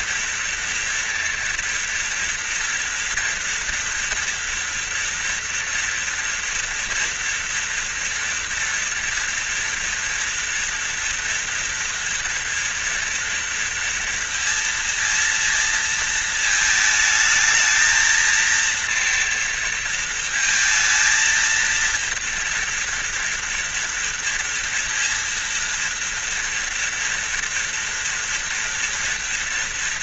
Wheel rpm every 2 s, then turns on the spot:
230, 230, 240, 240, 230, 230, 230, 230, 220, 230, 230, 230, 230, 230, 230.
none